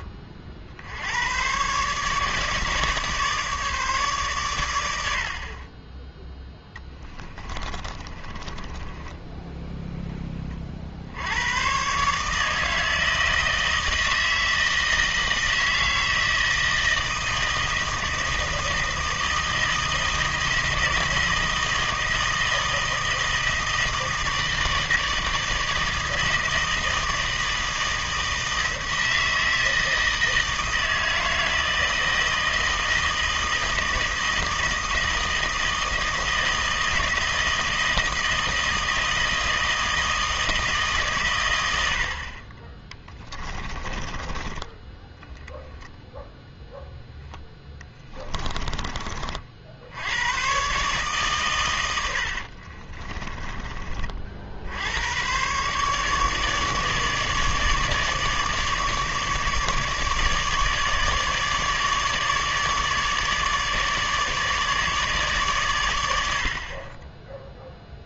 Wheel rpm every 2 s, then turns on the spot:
50, 150, 100, 10, 20, 40, 160, 160, 160, 160, 160, 160, 160, 160, 160, 160, 160, 160, 160, 160, 150, 20, 10, 0, 30, 130, 40, 70, 150, 150, 150, 150, 150, 50.
6-10 48-50 52-54